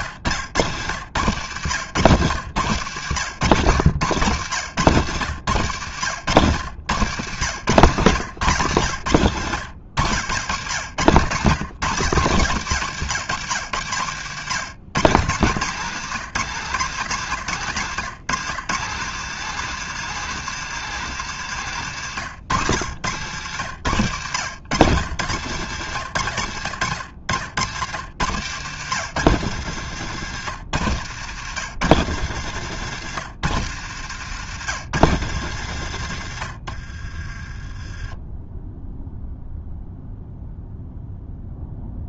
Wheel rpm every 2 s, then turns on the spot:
100, 100, 110, 110, 110, 80, 100, 120, 130, 160, 190, 100, 110, 80, 110, 110, 110, 120, 50, 0, 0.
32-34 36-38